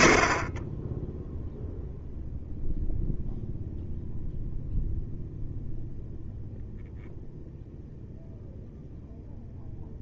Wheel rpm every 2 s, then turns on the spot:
20, 0, 0, 0, 0.
none